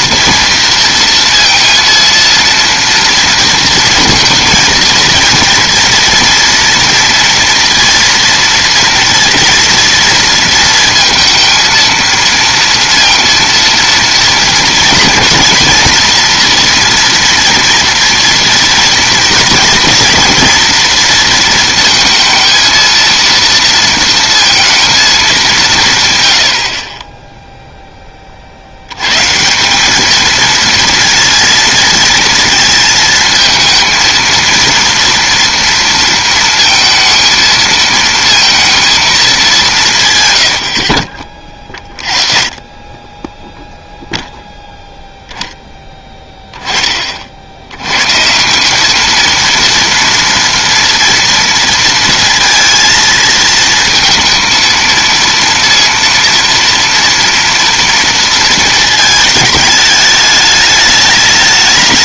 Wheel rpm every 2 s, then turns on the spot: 230, 230, 230, 230, 230, 230, 230, 230, 230, 230, 230, 230, 230, 60, 70, 230, 230, 230, 230, 230, 80, 20, 0, 20, 190, 230, 230, 230, 230, 230, 210.
none